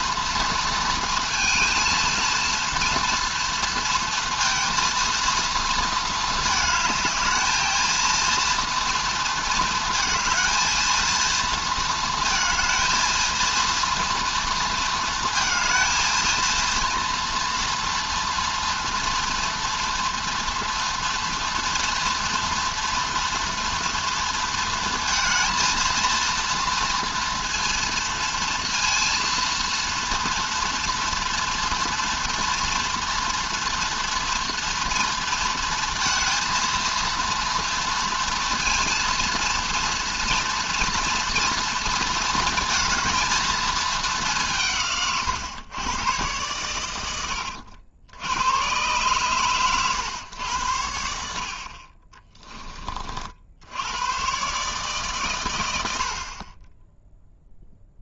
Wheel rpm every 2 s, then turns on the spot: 220, 230, 230, 220, 230, 230, 230, 230, 230, 240, 230, 230, 230, 230, 230, 230, 240, 230, 230, 230, 230, 220, 140, 100, 120, 80, 30, 140, 10.
none